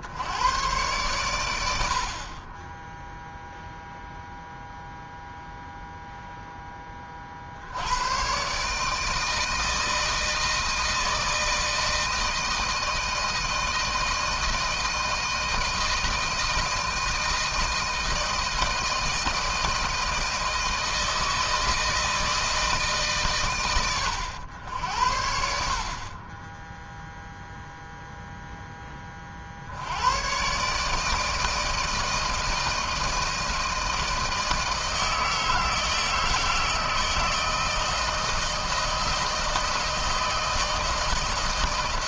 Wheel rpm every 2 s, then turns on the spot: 110, 30, 0, 10, 130, 160, 160, 160, 160, 160, 160, 160, 90, 30, 0, 130, 160, 160, 160, 160, 160.
none